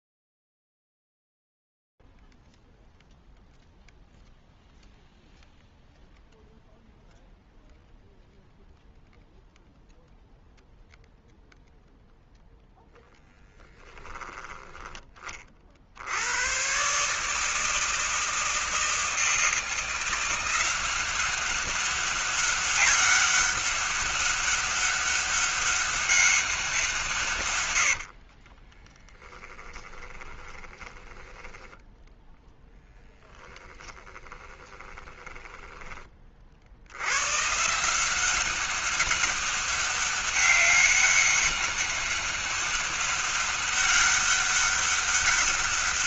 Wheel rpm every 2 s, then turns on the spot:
0, 0, 0, 0, 0, 0, 0, 10, 120, 160, 180, 200, 200, 190, 20, 10, 0, 20, 70, 190, 200, 200, 200.
28-32 34-36